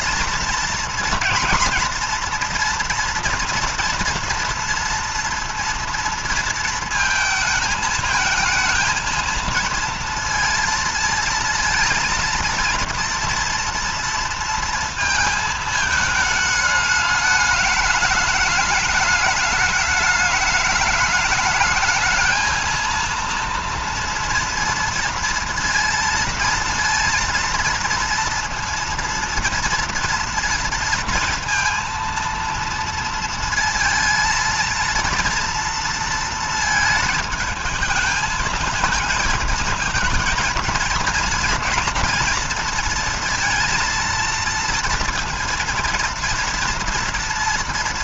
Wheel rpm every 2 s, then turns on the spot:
230, 240, 230, 230, 220, 230, 230, 230, 210, 210, 210, 230, 230, 230, 230, 230, 230, 230, 220, 220, 230, 230, 230, 240.
none